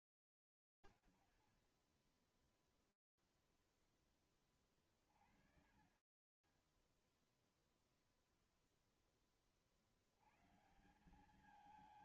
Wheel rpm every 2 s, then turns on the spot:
30, 30, 0, 20, 0, 150.
none